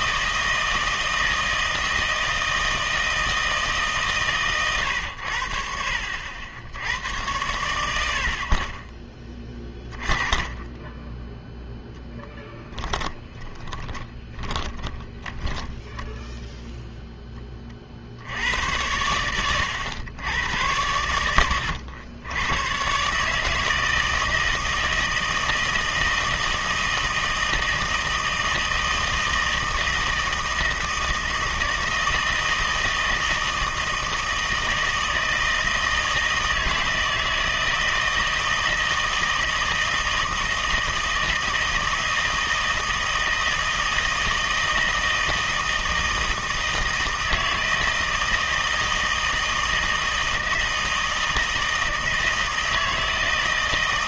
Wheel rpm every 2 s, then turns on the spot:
160, 160, 120, 80, 40, 10, 10, 10, 0, 90, 100, 110, 160, 160, 160, 160, 160, 160, 160, 160, 160, 160, 160, 160, 160, 160, 160.
12-16